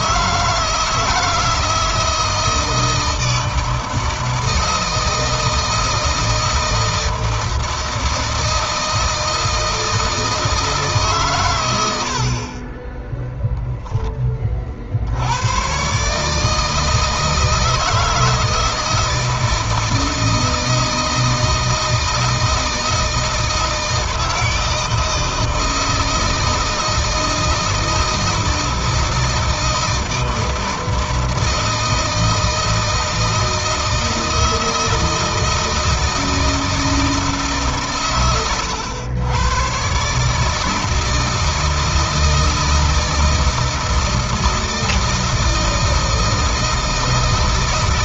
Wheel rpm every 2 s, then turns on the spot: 160, 160, 160, 160, 160, 150, 20, 60, 160, 160, 160, 160, 160, 160, 160, 160, 160, 160, 160, 90, 160, 160, 160, 160.
none